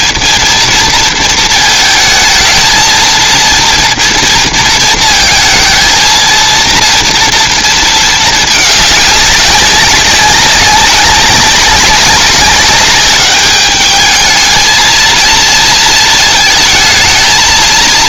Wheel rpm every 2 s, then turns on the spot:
230, 230, 230, 230, 210, 190, 200, 230, 220.
none